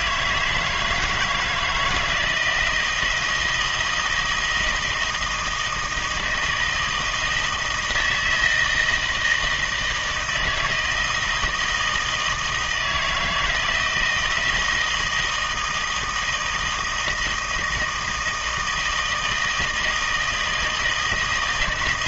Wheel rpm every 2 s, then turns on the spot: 160, 160, 160, 160, 160, 160, 160, 170, 160, 160, 160.
none